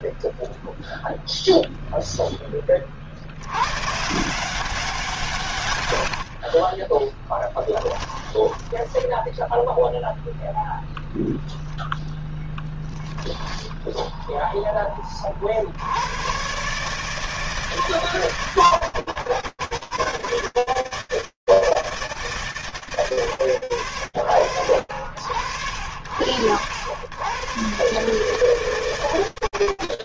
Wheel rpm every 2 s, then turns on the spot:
0, 0, 100, 130, 10, 0, 10, 10, 50, 160, 150, 80, 70, 80, 160.
8-10